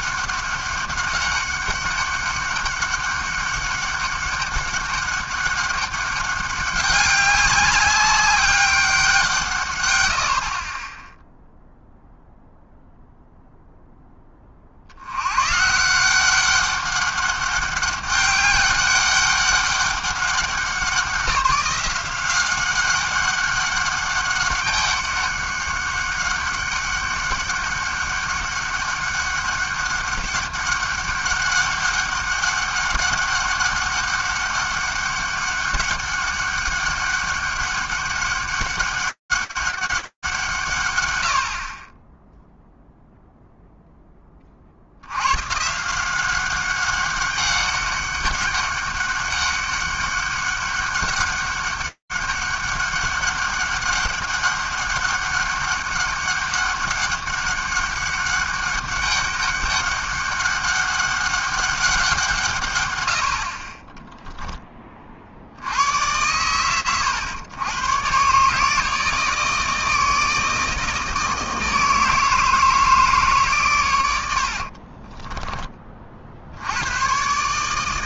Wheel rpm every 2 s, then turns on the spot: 190, 200, 200, 200, 200, 70, 0, 30, 190, 200, 180, 190, 200, 200, 200, 200, 200, 200, 200, 200, 140, 0, 30, 190, 200, 200, 200, 200, 200, 200, 200, 140, 0, 100, 140, 160, 160, 80, 60.
74-76